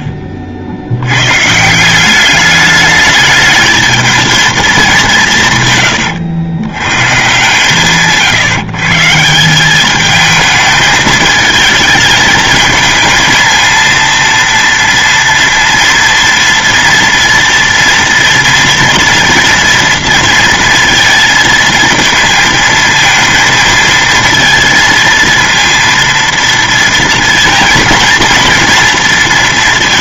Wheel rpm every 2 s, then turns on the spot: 60, 210, 210, 120, 140, 220, 220, 230, 230, 230, 230, 230, 230, 230, 230.
none